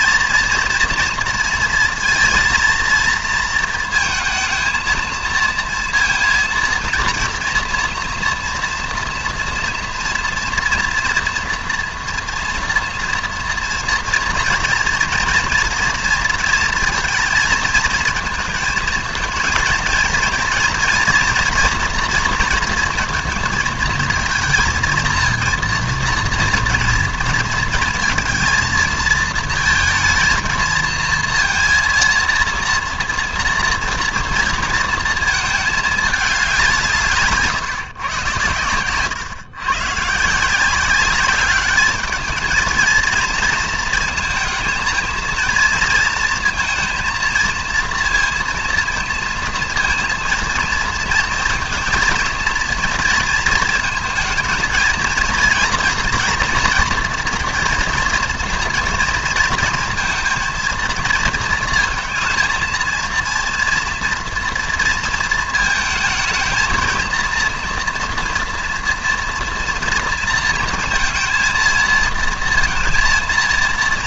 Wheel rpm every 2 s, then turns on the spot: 230, 230, 220, 230, 230, 230, 230, 230, 230, 220, 230, 230, 230, 230, 230, 230, 230, 230, 170, 110, 180, 220, 230, 230, 230, 230, 230, 220, 230, 230, 230, 230, 230, 220, 230, 230, 230.
none